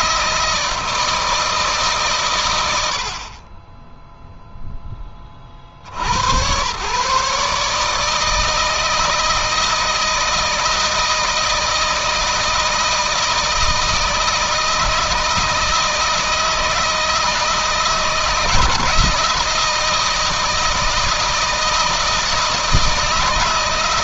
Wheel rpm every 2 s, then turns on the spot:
160, 80, 10, 120, 160, 170, 160, 160, 160, 160, 160, 160.
none